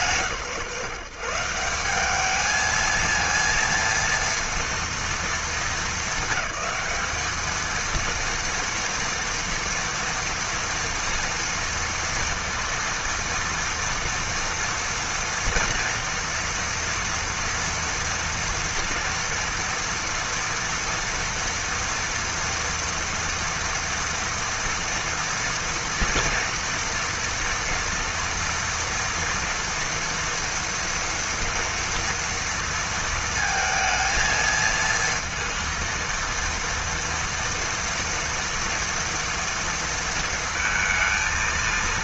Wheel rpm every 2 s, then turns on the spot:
130, 220, 230, 200, 230, 230, 230, 240, 230, 240, 230, 230, 230, 230, 230, 230, 230, 230, 230, 230, 230.
none